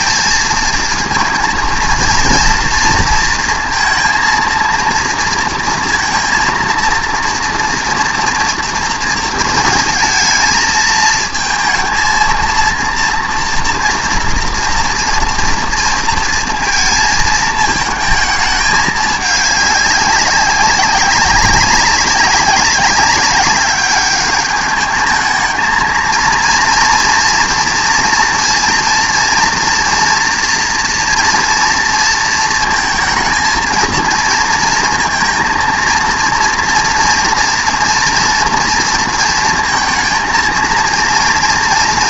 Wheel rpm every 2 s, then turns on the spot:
230, 230, 230, 230, 230, 230, 230, 230, 230, 210, 190, 190, 210, 230, 230, 230, 230, 230, 230, 230, 230.
none